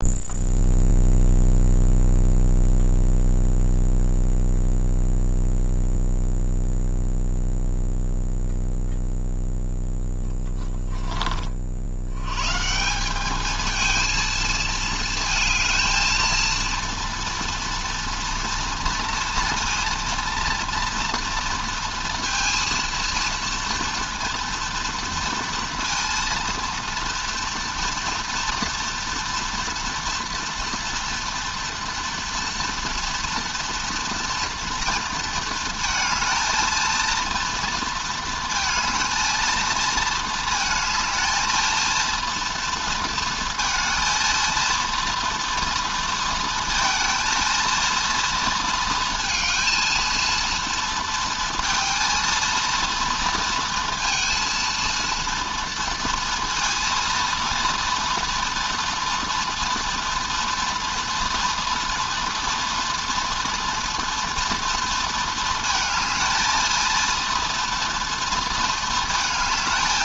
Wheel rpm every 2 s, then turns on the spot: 0, 0, 0, 0, 0, 10, 150, 230, 230, 230, 230, 230, 230, 230, 230, 230, 230, 230, 220, 230, 230, 230, 230, 230, 230, 230, 230, 230, 230, 240, 230, 230, 230, 220, 220.
10-12